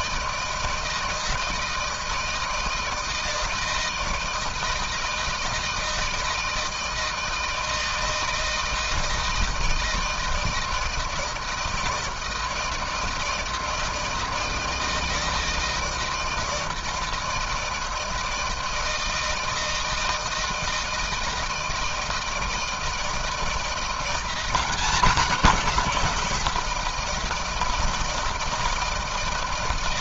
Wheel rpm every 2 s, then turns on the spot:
160, 160, 160, 160, 160, 160, 160, 160, 160, 160, 160, 160, 180, 170, 160.
none